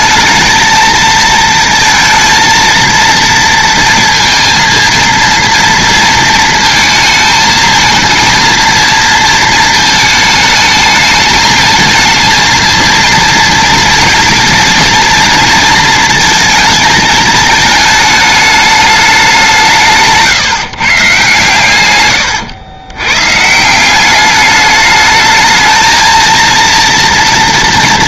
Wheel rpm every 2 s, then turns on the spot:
230, 230, 230, 220, 230, 220, 230, 230, 220, 210, 150, 120, 210, 230.
none